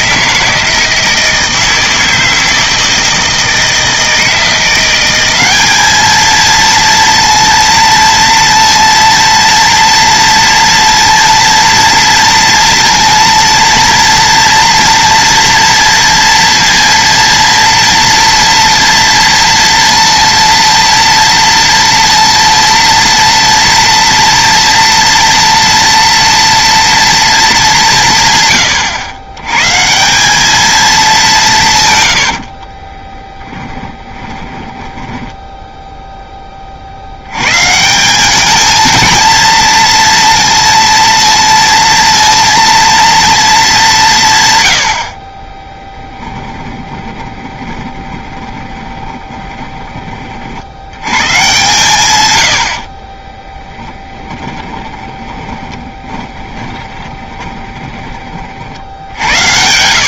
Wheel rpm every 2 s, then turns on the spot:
160, 160, 180, 230, 230, 230, 230, 230, 230, 230, 230, 230, 230, 230, 120, 210, 30, 20, 60, 220, 230, 230, 100, 20, 20, 90, 50, 20, 20, 60.
32-36 46-50 52-60